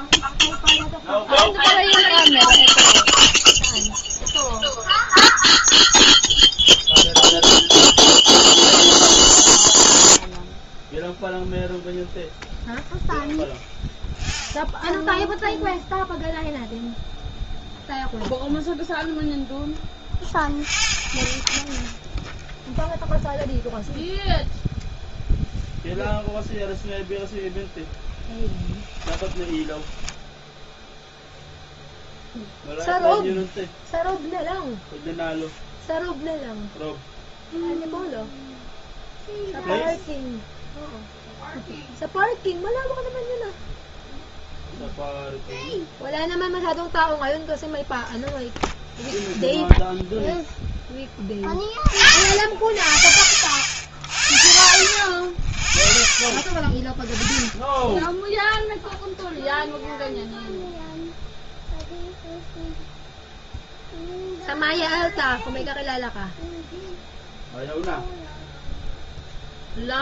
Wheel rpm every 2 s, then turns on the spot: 0, 0, 0, 0, 0, 0, 0, 0, 0, 0, 0, 0, 0, 0, 10, 10, 0, 0, 0, 0, 0, 0, 0, 0, 0, 0, 0, 0, 0, 0, 0, 0, 0, 0, 0.
28-30